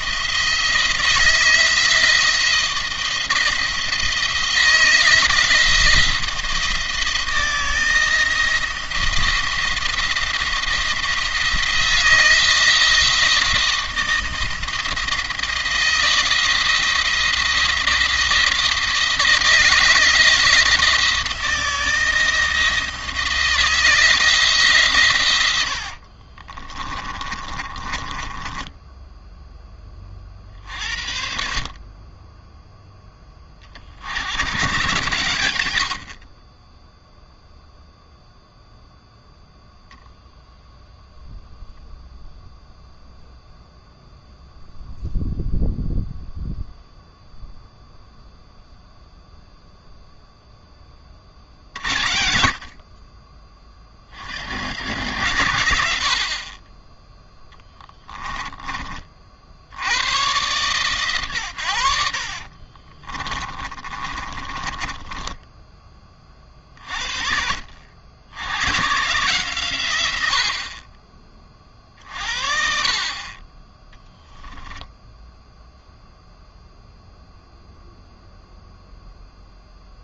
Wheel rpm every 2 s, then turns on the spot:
160, 160, 160, 170, 170, 170, 170, 160, 170, 160, 160, 160, 150, 30, 20, 60, 20, 110, 20, 0, 0, 0, 0, 0, 0, 10, 50, 70, 30, 30, 130, 40, 20, 40, 120, 50, 50, 0, 0, 0.
26-30 62-66